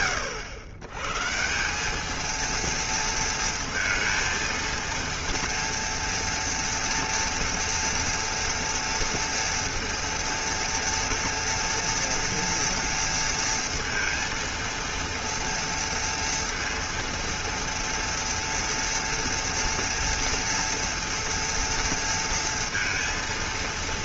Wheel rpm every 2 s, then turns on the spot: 100, 230, 230, 230, 230, 230, 230, 230, 230, 230, 230, 230.
none